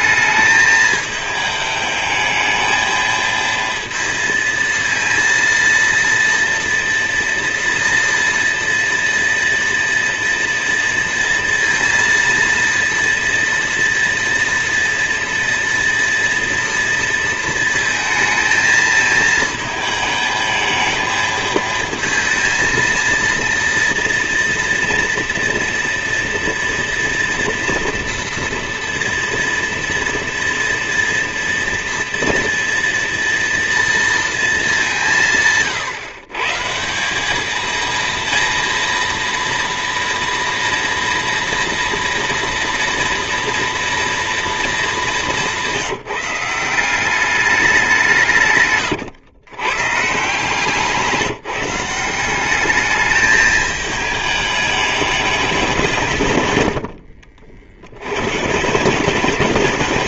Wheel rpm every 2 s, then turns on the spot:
220, 220, 230, 240, 230, 230, 230, 230, 230, 220, 220, 230, 230, 230, 230, 240, 230, 170, 170, 230, 230, 230, 200, 190, 120, 170, 210, 210, 90, 190.
56-58